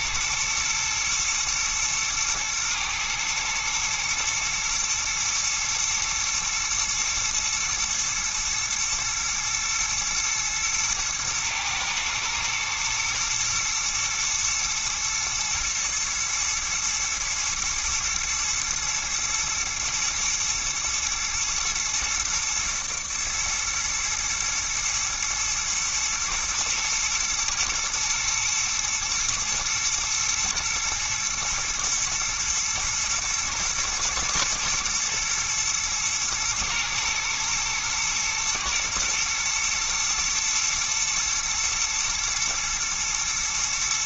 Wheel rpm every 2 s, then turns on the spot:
110, 110, 110, 110, 110, 120, 120, 120, 110, 110, 110, 110, 110, 110, 120, 120, 110, 120, 110, 110, 120, 110.
none